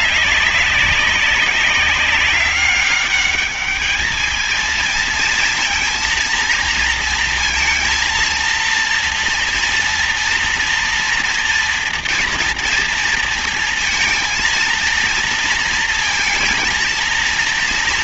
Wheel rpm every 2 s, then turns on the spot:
200, 200, 220, 230, 230, 230, 230, 230, 230.
none